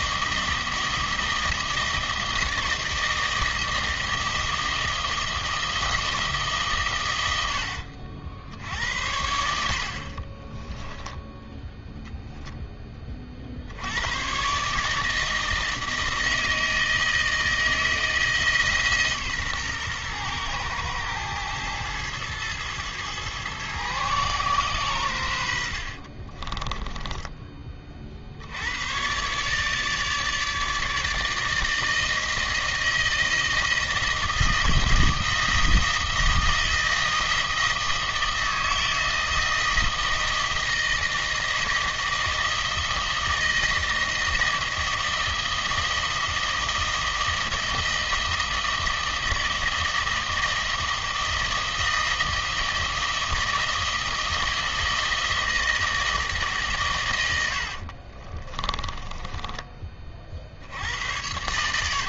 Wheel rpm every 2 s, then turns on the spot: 160, 160, 160, 150, 70, 20, 0, 130, 160, 160, 110, 110, 120, 30, 80, 150, 160, 160, 160, 160, 160, 160, 160, 160, 160, 160, 160, 160, 150, 30, 70.
10-12 26-28 58-60